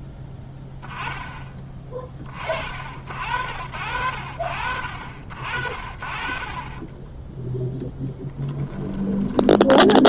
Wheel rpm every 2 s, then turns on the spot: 10, 50, 40, 20, 10.
8-10